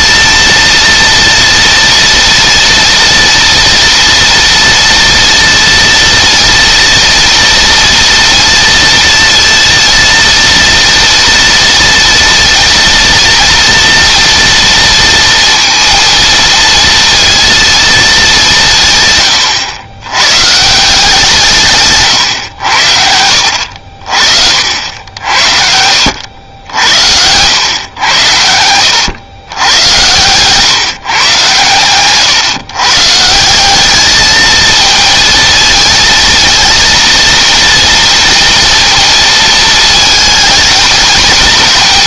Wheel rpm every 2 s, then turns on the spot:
230, 230, 230, 230, 230, 230, 230, 230, 230, 140, 160, 70, 70, 80, 90, 140, 150, 220, 230, 230, 220.
none